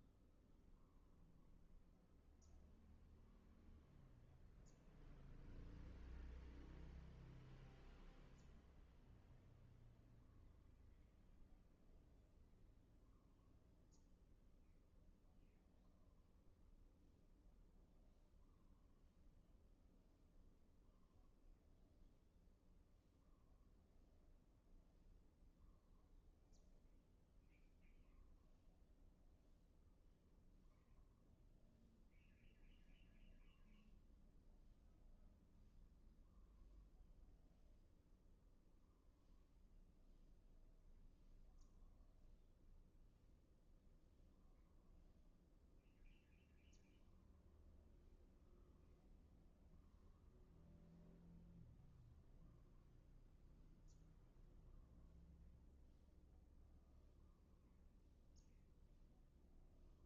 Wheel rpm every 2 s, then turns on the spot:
0, 0, 0, 0, 0, 0, 0, 0, 0, 0, 0, 0, 0, 0, 0, 0, 0, 0, 0, 0, 0, 0, 0, 0, 0, 0, 0, 0, 0, 0.
none